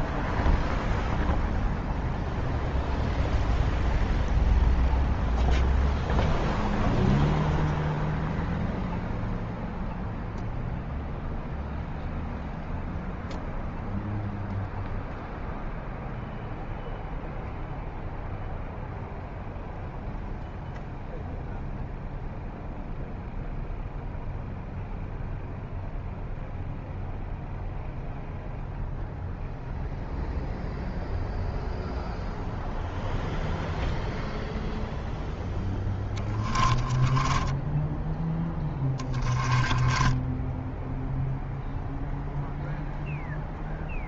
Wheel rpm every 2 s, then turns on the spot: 0, 0, 0, 0, 0, 0, 0, 0, 0, 0, 0, 0, 0, 0, 0, 0, 0, 0, 20, 10, 10, 0.
36-42